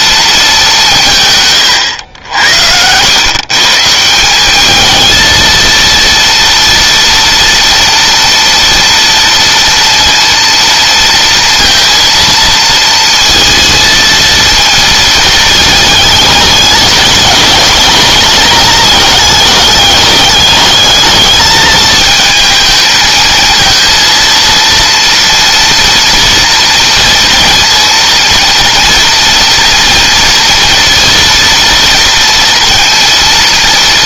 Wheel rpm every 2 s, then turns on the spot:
170, 100, 220, 230, 230, 230, 230, 220, 210, 220, 210, 220, 230, 240, 230, 230, 230.
none